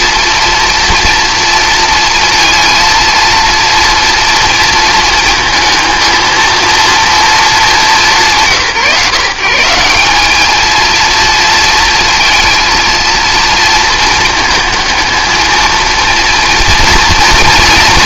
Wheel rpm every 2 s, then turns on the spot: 230, 230, 230, 230, 180, 200, 220, 220, 230.
none